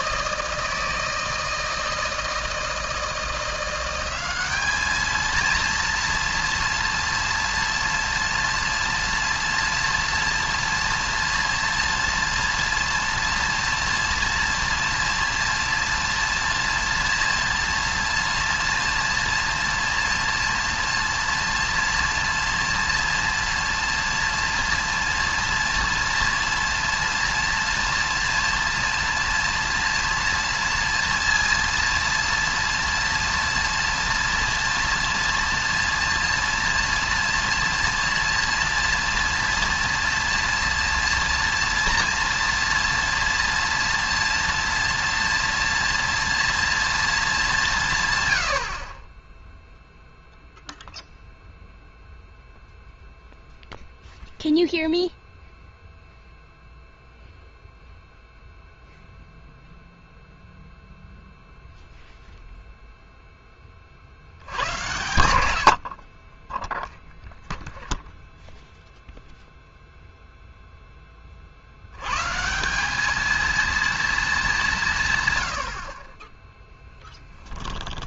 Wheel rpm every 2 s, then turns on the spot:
160, 160, 210, 230, 230, 230, 230, 230, 230, 230, 230, 230, 230, 230, 230, 230, 230, 230, 230, 230, 230, 230, 230, 230, 80, 0, 0, 0, 0, 0, 0, 0, 100, 10, 0, 0, 170, 190, 10.
none